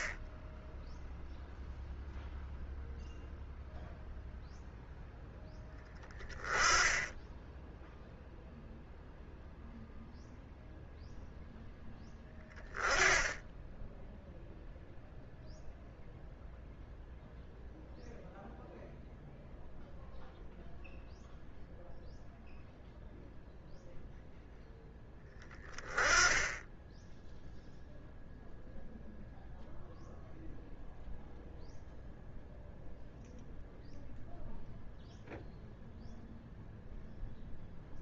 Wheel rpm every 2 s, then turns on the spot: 10, 0, 0, 10, 0, 0, 10, 0, 0, 0, 0, 0, 0, 10, 0, 0, 0, 0, 0.
none